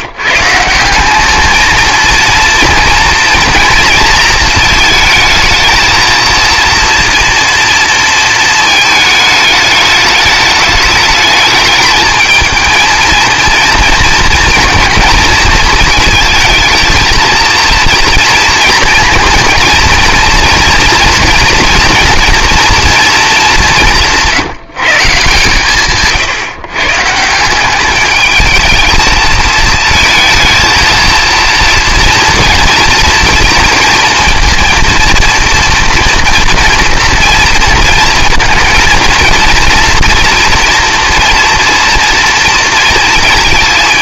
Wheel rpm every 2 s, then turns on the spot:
170, 230, 220, 230, 220, 210, 220, 230, 230, 230, 230, 240, 150, 140, 210, 230, 230, 240, 230, 230, 240, 230.
none